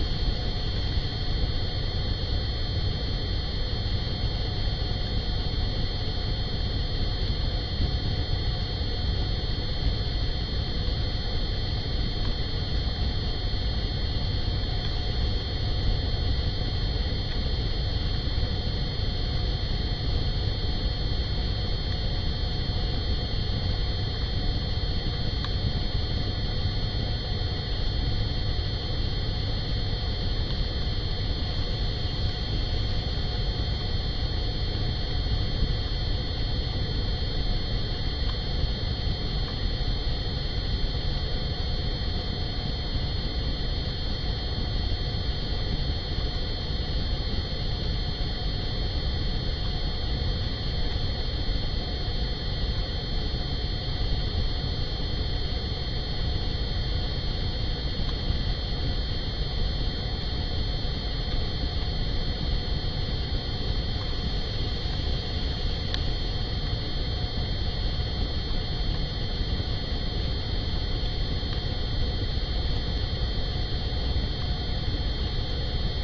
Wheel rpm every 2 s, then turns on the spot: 0, 0, 0, 0, 0, 0, 0, 0, 0, 0, 0, 0, 0, 0, 0, 0, 0, 0, 0, 0, 0, 0, 0, 0, 0, 0, 0, 0, 0, 0, 0, 0, 0, 0, 0, 0, 0, 0.
none